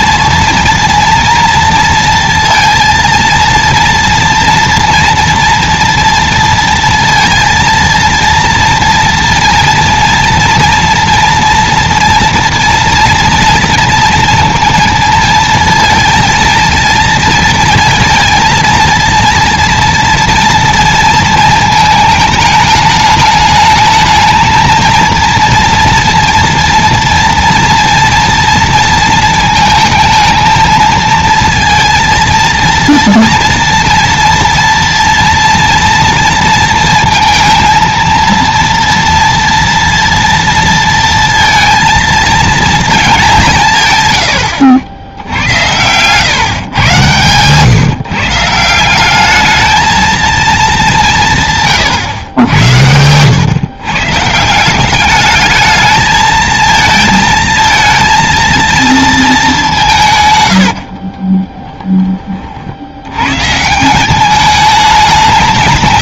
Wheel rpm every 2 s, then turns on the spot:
230, 230, 230, 230, 230, 230, 230, 230, 230, 230, 230, 210, 230, 230, 230, 220, 230, 230, 230, 230, 230, 220, 80, 130, 180, 210, 100, 180, 220, 230, 60, 70, 190.
60-62